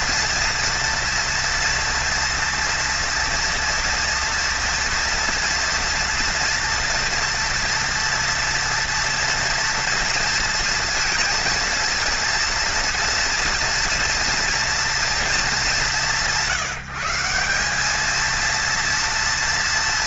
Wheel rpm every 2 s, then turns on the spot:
230, 230, 230, 230, 230, 230, 230, 230, 160, 230.
none